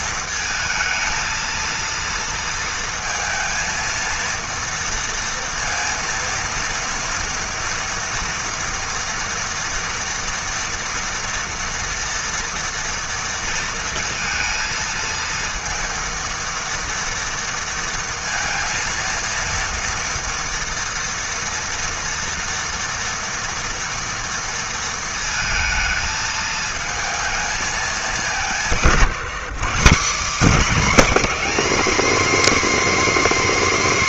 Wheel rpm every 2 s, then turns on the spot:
230, 230, 230, 230, 240, 230, 230, 230, 230, 230, 230, 230, 230, 220, 200, 240, 290.
none